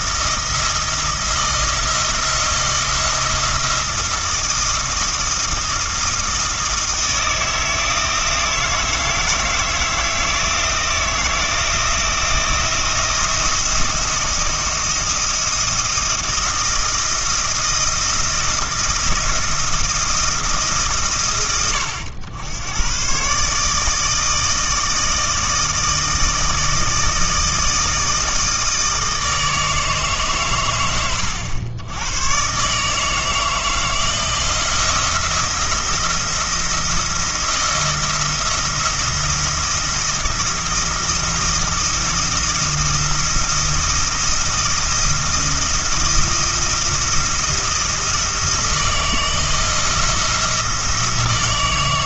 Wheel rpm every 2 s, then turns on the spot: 160, 170, 170, 160, 160, 160, 170, 170, 170, 170, 160, 100, 160, 160, 160, 110, 140, 170, 170, 170, 170, 170, 170, 170, 160, 170.
none